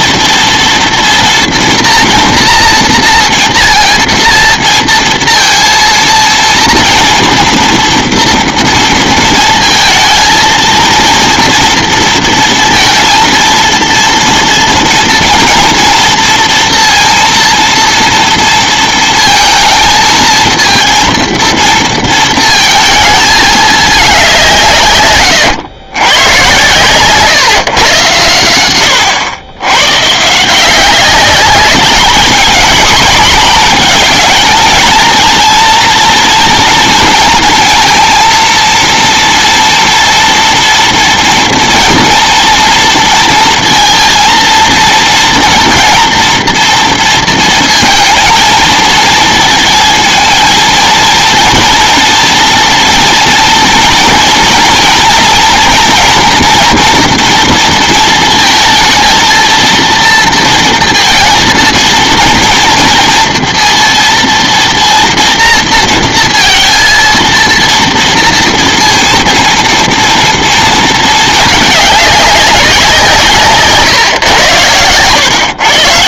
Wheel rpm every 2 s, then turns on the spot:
230, 230, 230, 230, 230, 230, 230, 230, 230, 230, 230, 230, 150, 130, 100, 180, 220, 220, 230, 230, 240, 230, 230, 230, 220, 230, 230, 230, 230, 220, 230, 230, 230, 230, 230, 220, 180, 110.
26-28